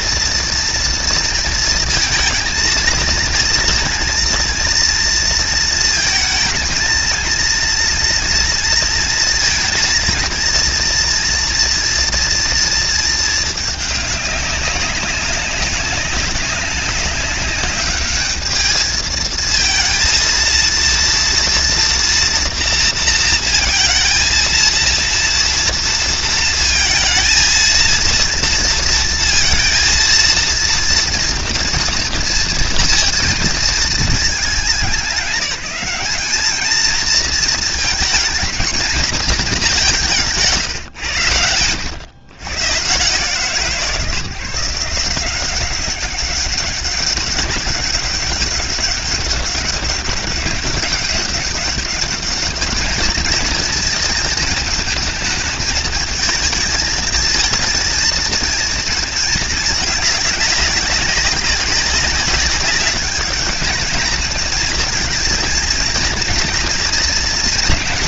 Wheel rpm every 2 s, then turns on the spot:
230, 230, 230, 230, 230, 230, 220, 190, 200, 220, 230, 230, 230, 230, 230, 230, 230, 200, 220, 230, 120, 140, 170, 200, 200, 200, 220, 220, 220, 230, 200, 200, 220, 230.
none